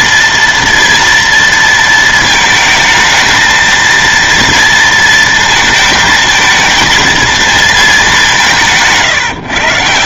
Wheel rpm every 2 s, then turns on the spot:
230, 220, 230, 230, 150.
8-10